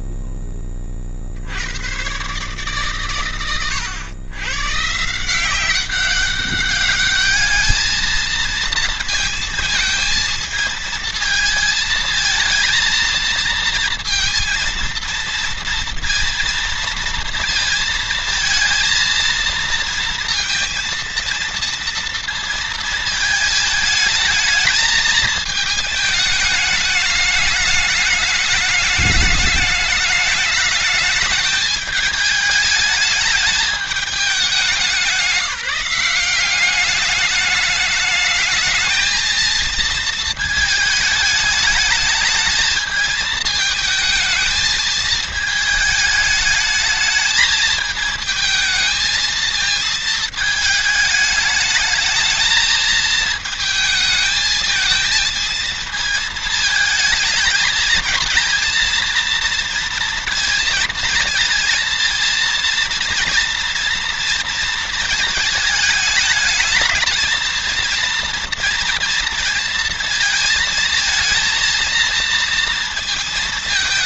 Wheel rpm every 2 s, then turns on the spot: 20, 120, 130, 200, 220, 220, 230, 230, 230, 230, 230, 230, 220, 210, 210, 210, 210, 200, 190, 220, 220, 220, 220, 220, 220, 220, 220, 220, 220, 220, 230, 230, 230, 210, 230, 220, 230.
none